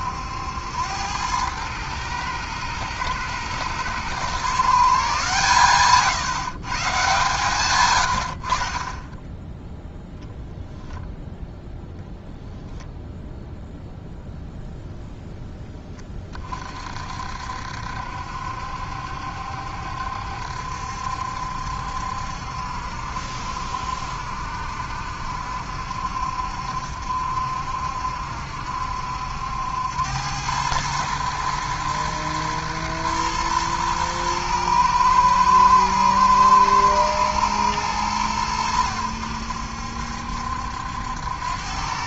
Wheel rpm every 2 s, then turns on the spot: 90, 120, 140, 130, 30, 0, 0, 0, 40, 70, 70, 70, 70, 60, 70, 110, 110, 110, 120, 90, 80.
none